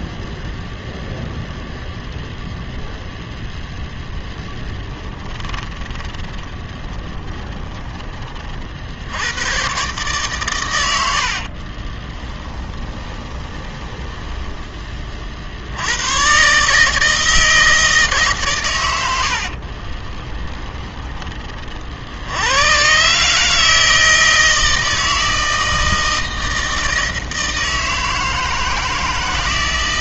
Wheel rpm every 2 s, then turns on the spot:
0, 0, 10, 20, 60, 90, 20, 20, 150, 120, 20, 110, 160, 160, 160.
4-8 12-14 20-22